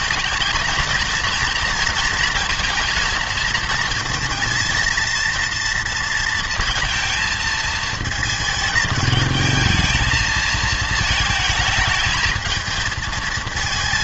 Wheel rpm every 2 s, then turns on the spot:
220, 230, 230, 230, 220, 220, 220.
none